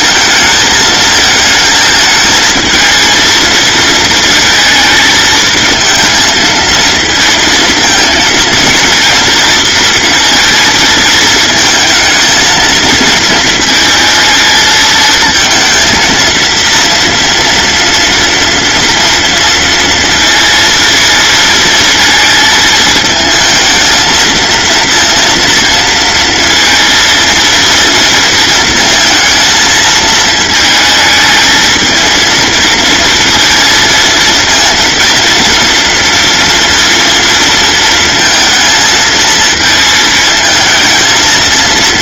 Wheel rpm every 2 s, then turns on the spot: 220, 230, 220, 230, 230, 220, 220, 220, 230, 230, 230, 220, 230, 230, 230, 220, 230, 230, 230, 230, 220.
none